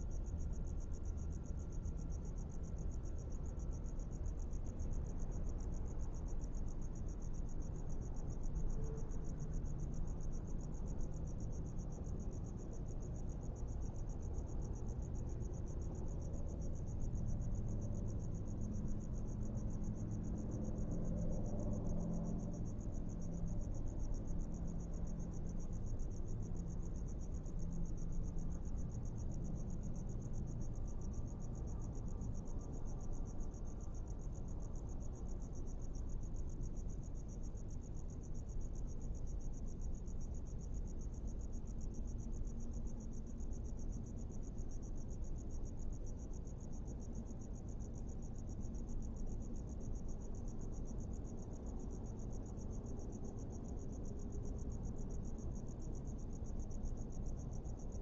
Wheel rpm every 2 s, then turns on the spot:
0, 0, 0, 0, 0, 0, 0, 0, 0, 0, 0, 0, 0, 0, 0, 0, 0, 0, 0, 0, 0, 0, 0, 0, 0, 0, 0, 0, 0.
none